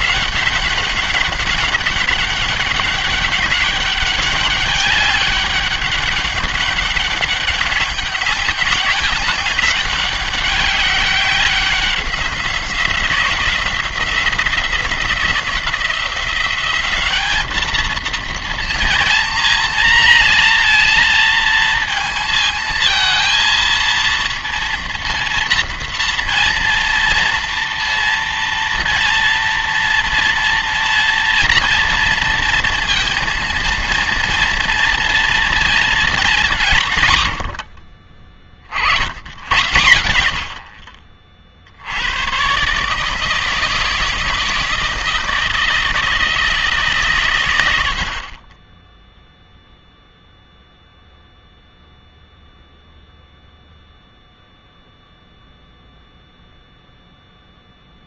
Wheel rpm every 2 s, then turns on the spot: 200, 200, 200, 200, 200, 200, 180, 180, 200, 230, 230, 220, 230, 230, 230, 230, 230, 230, 160, 60, 70, 140, 160, 150, 20, 0, 0, 0, 0.
none